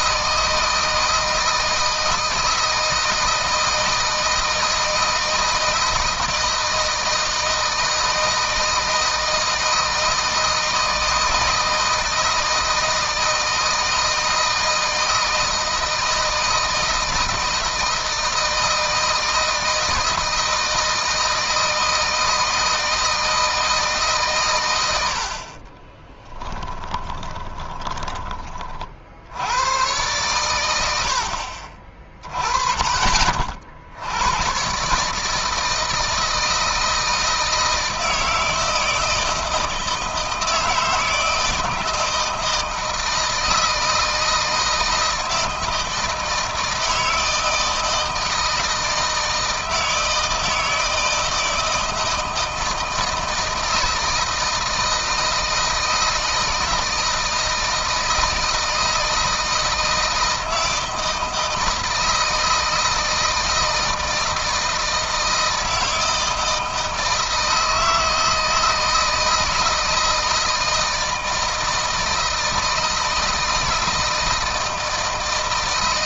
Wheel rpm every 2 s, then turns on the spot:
160, 160, 160, 160, 160, 160, 160, 170, 160, 160, 160, 160, 90, 10, 50, 70, 30, 140, 160, 160, 160, 160, 160, 160, 160, 160, 160, 160, 170, 160, 160, 160, 160, 160, 160, 160, 160, 160.
26-28